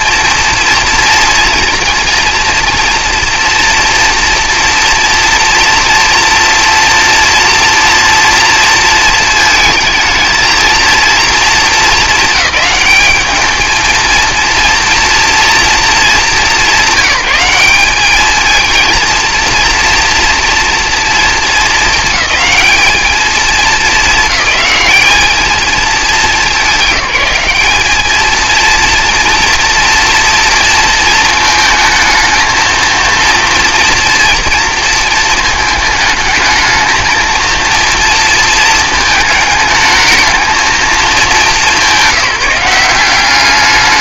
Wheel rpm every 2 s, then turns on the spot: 240, 230, 230, 230, 230, 230, 210, 230, 200, 220, 230, 210, 210, 190, 230, 230, 230, 230, 220, 220, 220, 180.
none